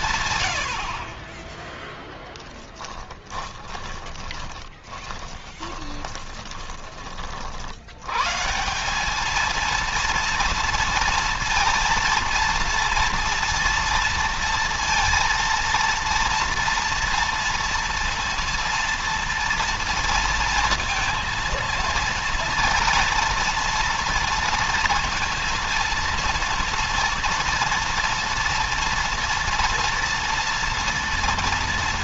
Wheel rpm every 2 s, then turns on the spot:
140, 10, 20, 20, 120, 230, 230, 230, 230, 230, 230, 230, 230, 230, 230, 230.
4-8